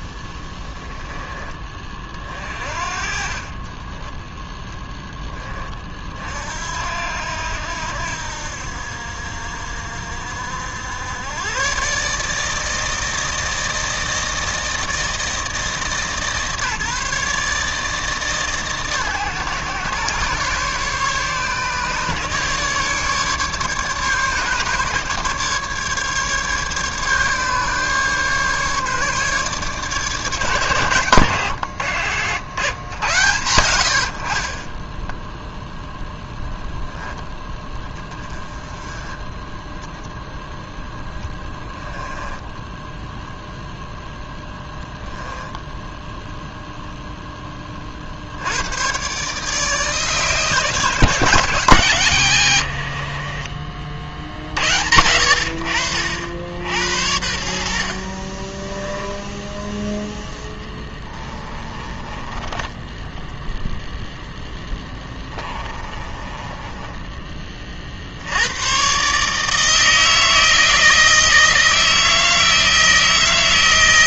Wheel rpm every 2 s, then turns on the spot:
10, 40, 10, 70, 70, 90, 160, 160, 150, 140, 140, 150, 140, 140, 150, 100, 110, 10, 0, 20, 0, 0, 10, 0, 120, 160, 70, 80, 70, 10, 10, 10, 10, 20, 130, 160, 160.
52-54 58-68